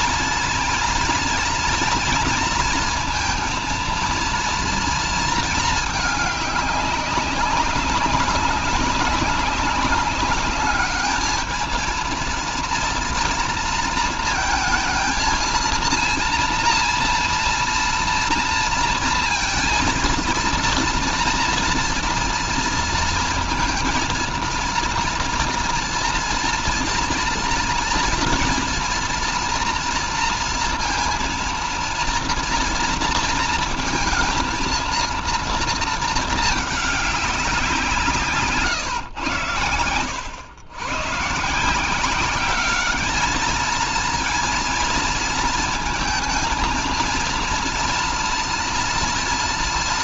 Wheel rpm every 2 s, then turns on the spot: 240, 230, 230, 200, 200, 210, 230, 220, 230, 230, 230, 230, 230, 230, 230, 230, 230, 230, 200, 120, 130, 210, 230, 230, 230.
none